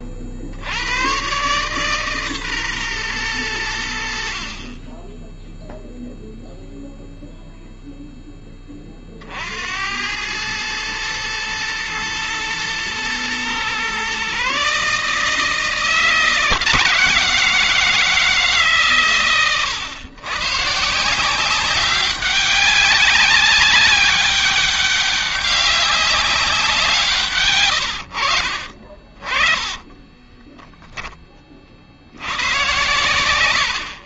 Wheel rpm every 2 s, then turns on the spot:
80, 130, 30, 0, 20, 110, 110, 140, 170, 140, 140, 190, 200, 190, 50, 10, 120.
none